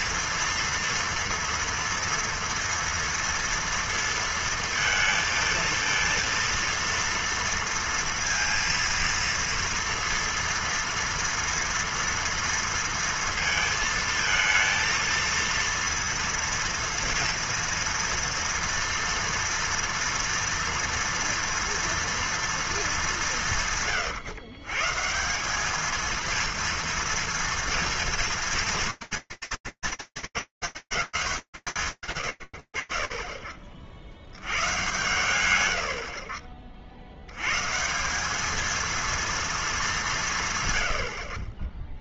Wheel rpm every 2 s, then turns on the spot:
230, 230, 230, 230, 230, 230, 230, 230, 230, 230, 230, 230, 120, 230, 230, 200, 110, 90, 50, 210, 130.
none